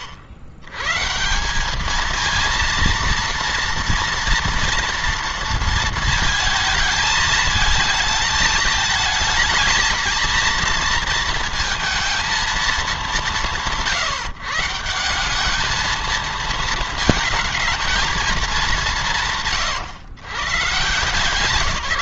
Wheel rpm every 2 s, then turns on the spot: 90, 230, 230, 230, 220, 230, 200, 140, 220, 200, 150.
none